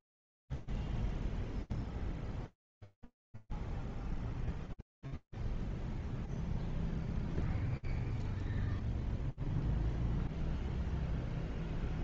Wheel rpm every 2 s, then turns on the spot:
0, 0, 0, 0, 0, 0.
none